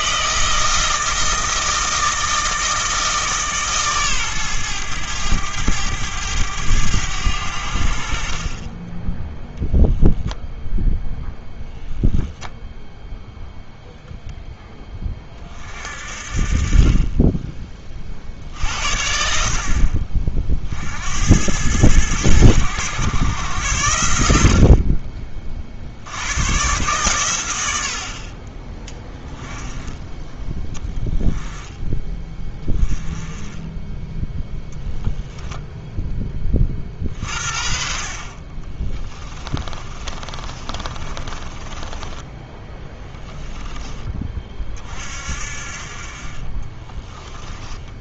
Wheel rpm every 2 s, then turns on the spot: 160, 160, 110, 100, 10, 0, 0, 10, 40, 60, 50, 110, 50, 120, 20, 20, 20, 0, 40, 30, 30, 10, 30, 30.
38-42 46-48